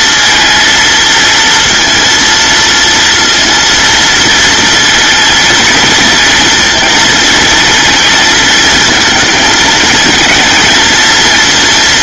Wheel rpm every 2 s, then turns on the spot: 230, 230, 230, 230, 220, 230.
none